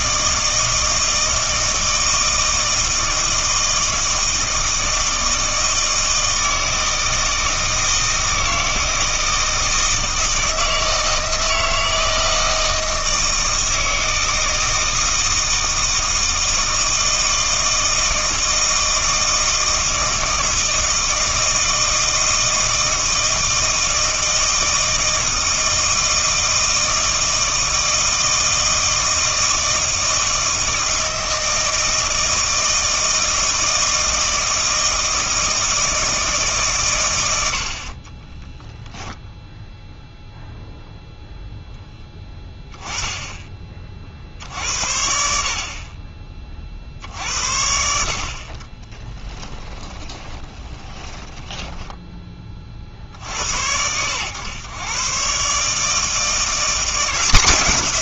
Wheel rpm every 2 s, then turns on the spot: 160, 160, 160, 160, 160, 160, 160, 160, 160, 160, 160, 160, 160, 160, 160, 160, 160, 160, 150, 10, 0, 10, 70, 40, 40, 20, 20, 100, 170.
38-40 50-52